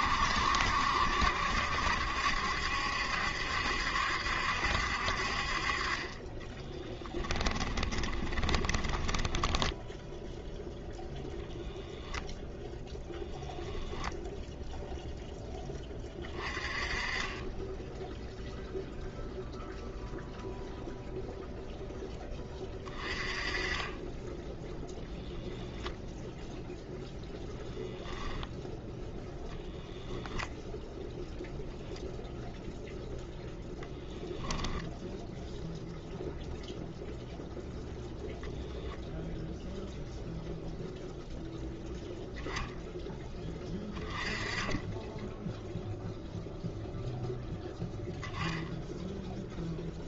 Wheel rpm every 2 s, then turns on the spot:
70, 70, 60, 10, 20, 0, 0, 0, 30, 0, 0, 20, 0, 0, 0, 20, 0, 0, 0, 0, 0, 0, 10, 0, 0.
6-10